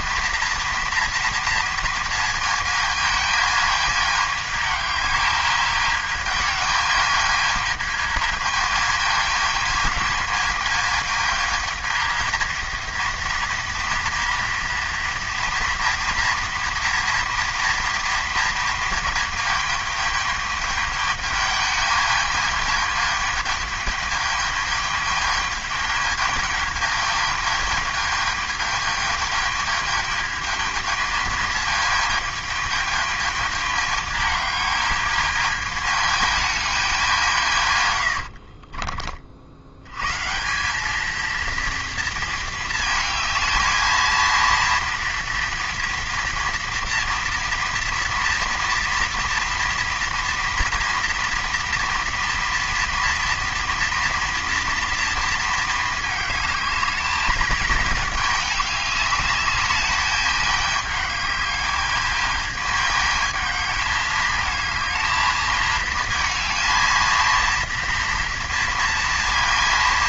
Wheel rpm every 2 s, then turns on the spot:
230, 220, 210, 220, 220, 220, 230, 230, 230, 220, 210, 210, 210, 210, 220, 220, 210, 220, 180, 50, 220, 220, 230, 230, 230, 230, 230, 230, 210, 210, 210, 210, 220, 230, 230.
none